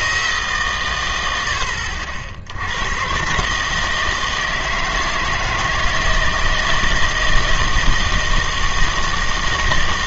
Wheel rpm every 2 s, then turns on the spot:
140, 80, 160, 160, 160.
none